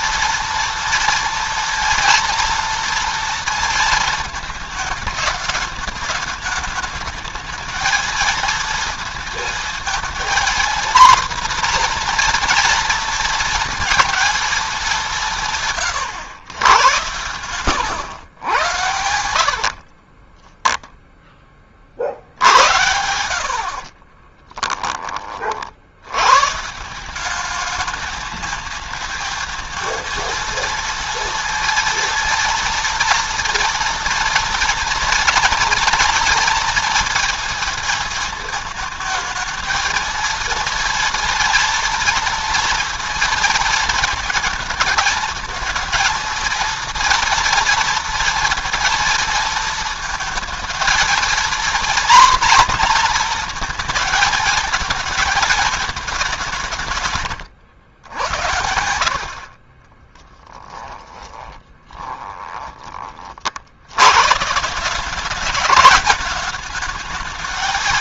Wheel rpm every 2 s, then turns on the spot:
230, 230, 220, 210, 230, 240, 240, 190, 110, 90, 0, 80, 30, 170, 220, 230, 230, 230, 230, 220, 230, 230, 220, 230, 230, 230, 240, 220, 160, 90, 20, 30, 180, 220.
60-62